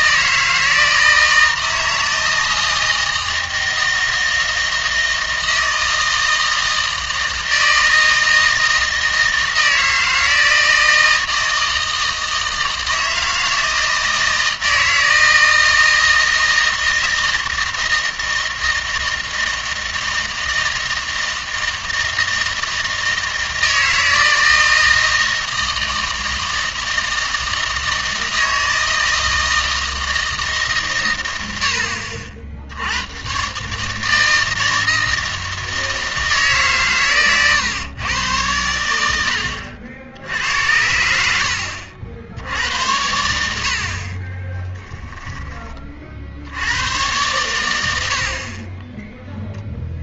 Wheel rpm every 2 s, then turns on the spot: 160, 160, 160, 160, 160, 160, 160, 160, 160, 160, 160, 160, 160, 160, 160, 140, 80, 160, 140, 90, 80, 80, 10, 90, 30.
44-46 48-50